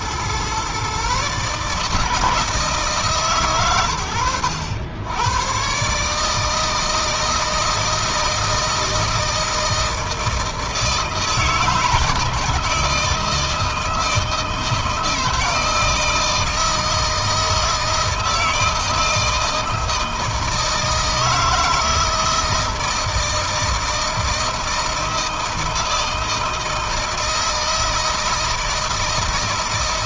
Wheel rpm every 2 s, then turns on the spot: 130, 150, 90, 160, 160, 160, 160, 160, 160, 160, 160, 160, 160, 160, 160.
none